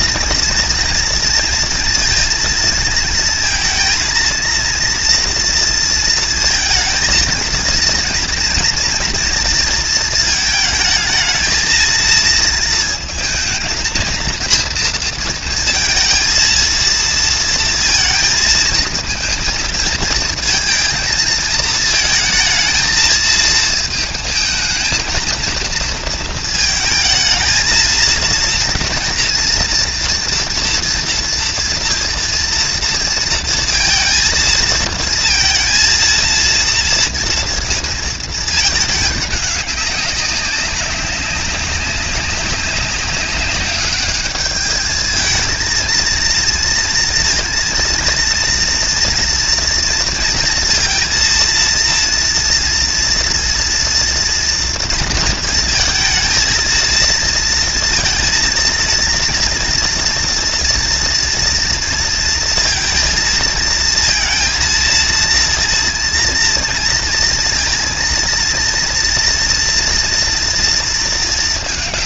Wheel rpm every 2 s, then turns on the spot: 230, 230, 230, 230, 230, 220, 220, 230, 230, 220, 230, 230, 220, 220, 230, 230, 230, 230, 230, 210, 200, 200, 210, 230, 230, 230, 230, 230, 230, 230, 230, 230, 230, 230, 230, 230.
none